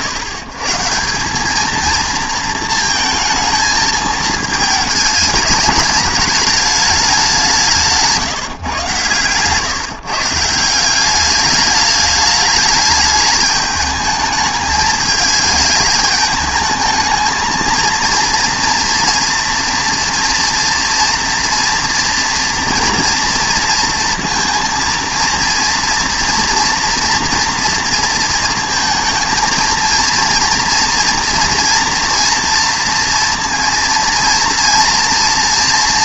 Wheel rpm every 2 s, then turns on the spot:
140, 220, 210, 210, 140, 170, 210, 220, 210, 230, 230, 230, 230, 230, 220, 230, 230, 230.
none